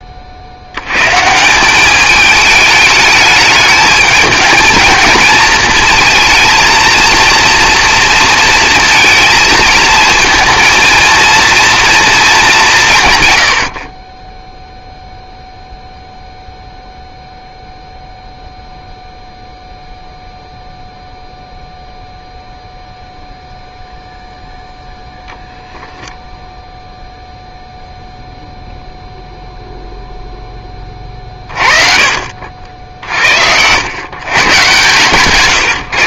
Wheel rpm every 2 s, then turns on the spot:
80, 210, 220, 230, 230, 230, 180, 0, 0, 0, 0, 0, 0, 0, 0, 20, 60, 130.
none